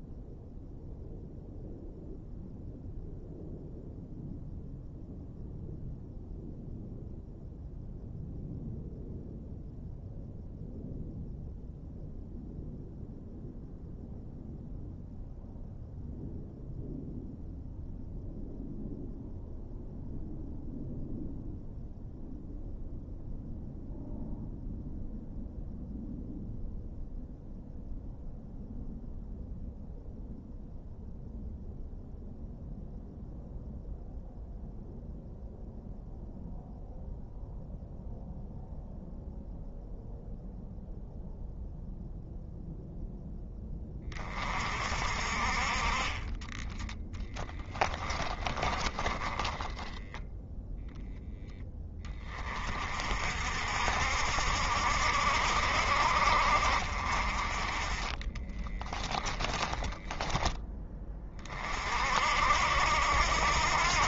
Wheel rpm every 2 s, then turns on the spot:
0, 0, 0, 0, 0, 0, 0, 0, 0, 0, 0, 0, 0, 0, 0, 0, 0, 0, 0, 0, 0, 0, 40, 20, 20, 0, 40, 60, 50, 10, 20, 70.
46-50 58-60